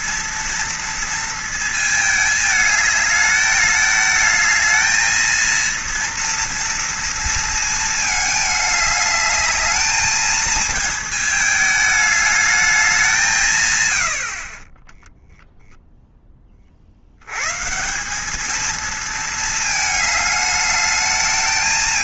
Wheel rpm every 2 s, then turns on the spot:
230, 210, 220, 230, 210, 220, 200, 20, 40, 220, 210.
none